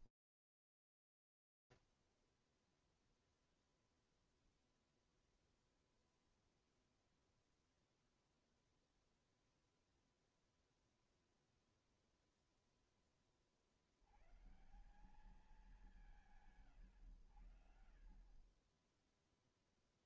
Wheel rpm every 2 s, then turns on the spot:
0, 0, 0, 0, 0, 0, 10, 140, 100, 20.
none